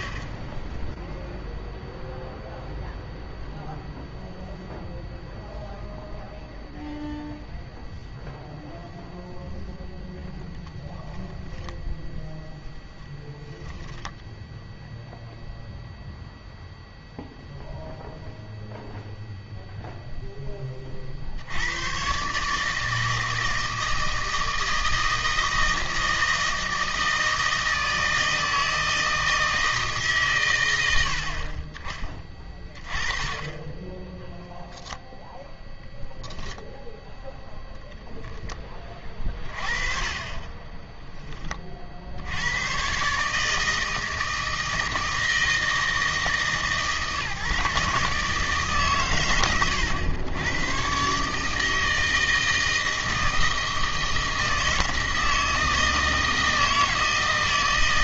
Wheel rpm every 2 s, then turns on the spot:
0, 0, 0, 0, 0, 10, 10, 0, 0, 0, 60, 160, 160, 160, 160, 70, 20, 0, 0, 30, 10, 130, 160, 150, 130, 130, 160, 160, 160.
none